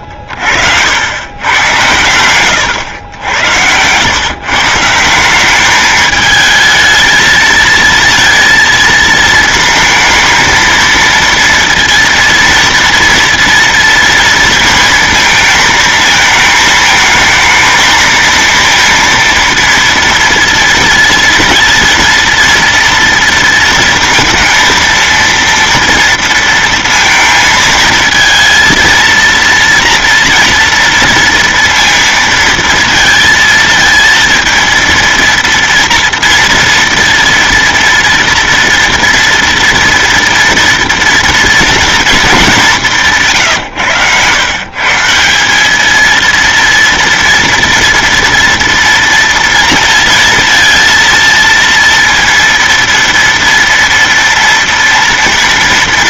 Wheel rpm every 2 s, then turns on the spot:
70, 110, 140, 220, 230, 230, 230, 230, 220, 230, 230, 230, 230, 230, 230, 230, 230, 230, 230, 230, 230, 190, 140, 230, 230, 230, 230, 230.
none